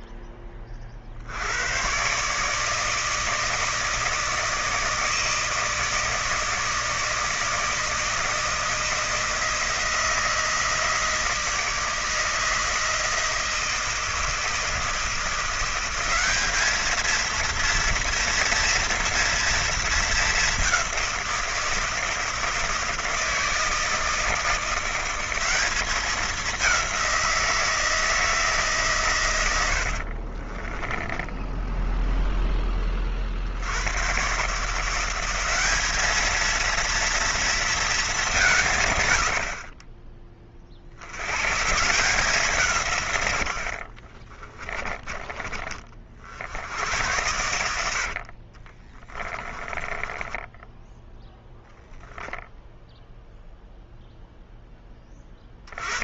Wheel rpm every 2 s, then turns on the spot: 30, 150, 160, 160, 160, 160, 160, 160, 210, 230, 190, 160, 180, 190, 140, 20, 20, 160, 230, 140, 50, 160, 20, 80, 30, 0, 0, 20.
30-32 44-46 48-50